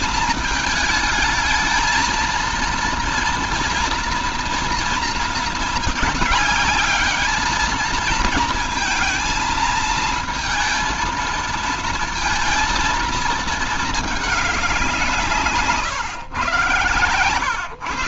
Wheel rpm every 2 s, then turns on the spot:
220, 230, 230, 210, 230, 230, 230, 190, 120.
none